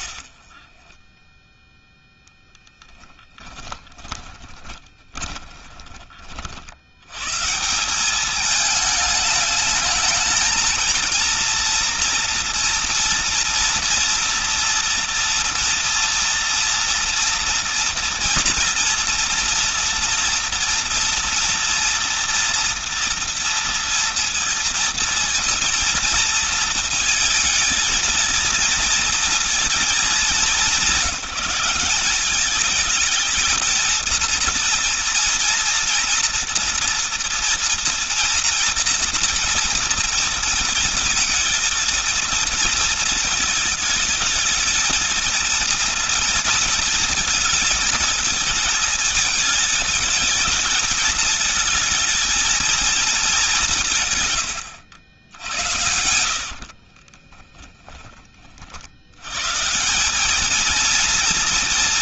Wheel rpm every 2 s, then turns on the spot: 20, 20, 40, 80, 210, 230, 230, 240, 230, 230, 230, 230, 230, 230, 230, 200, 210, 230, 230, 230, 230, 230, 220, 230, 220, 210, 220, 110, 50, 40, 220.
0-6 54-58